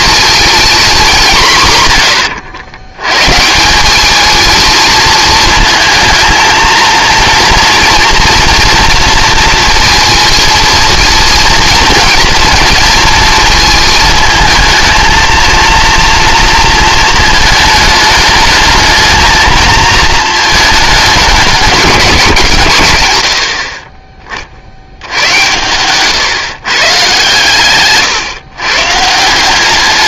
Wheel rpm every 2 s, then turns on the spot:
220, 100, 220, 230, 230, 230, 230, 220, 230, 220, 210, 130, 60, 130, 130.
none